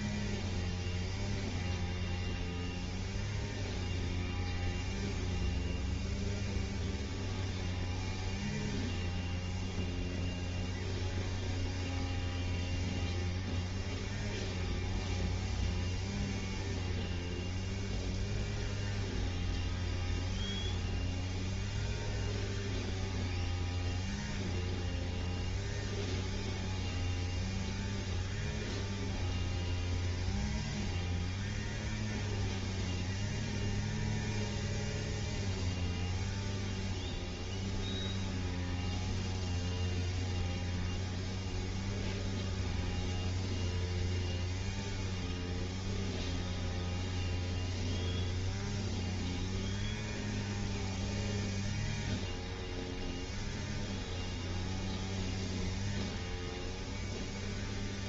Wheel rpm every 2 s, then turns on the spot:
0, 0, 0, 0, 0, 0, 0, 0, 0, 0, 0, 0, 0, 0, 0, 0, 0, 0, 0, 0, 0, 0, 0, 0, 0, 0, 0, 0, 0.
none